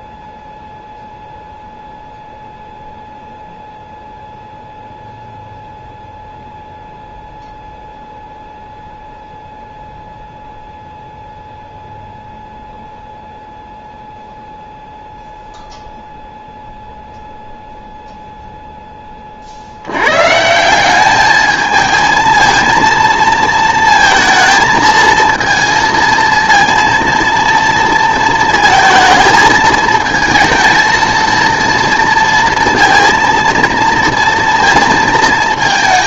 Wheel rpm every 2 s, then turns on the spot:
0, 0, 0, 0, 0, 0, 0, 0, 0, 0, 170, 230, 220, 230, 230, 230, 230, 230.
none